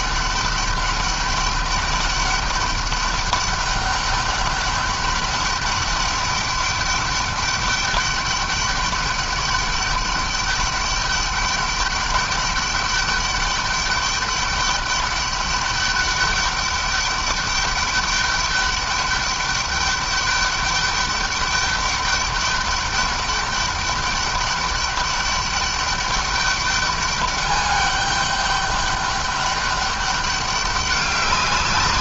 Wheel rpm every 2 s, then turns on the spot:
200, 200, 200, 200, 200, 200, 200, 200, 200, 200, 200, 200, 200, 200, 200, 200.
none